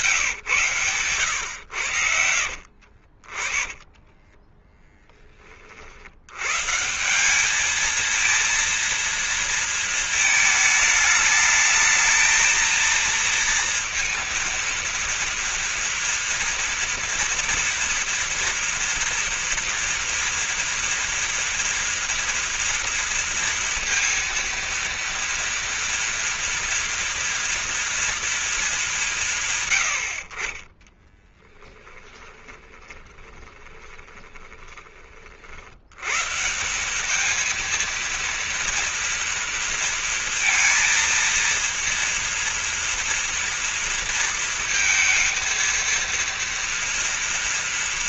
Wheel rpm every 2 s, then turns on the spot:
140, 60, 10, 150, 230, 210, 230, 230, 230, 230, 230, 230, 230, 230, 200, 30, 20, 20, 180, 230, 230, 230, 230, 230.
2-4 30-34